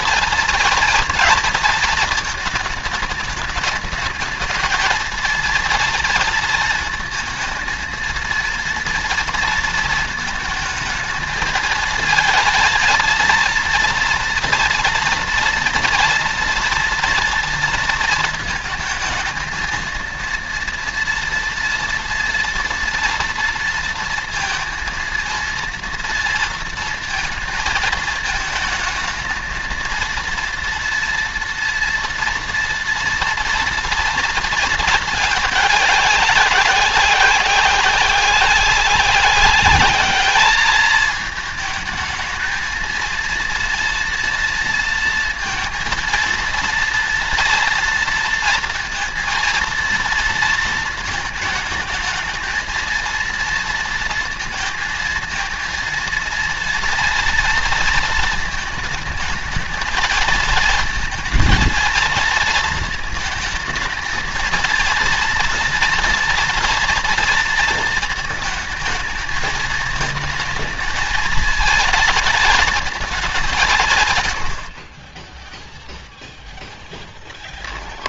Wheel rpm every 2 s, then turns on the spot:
230, 220, 220, 230, 230, 220, 230, 230, 230, 220, 230, 230, 230, 230, 220, 230, 230, 230, 200, 180, 210, 220, 230, 230, 230, 230, 230, 230, 240, 220, 230, 220, 220, 230, 220, 220, 230, 50, 0.
none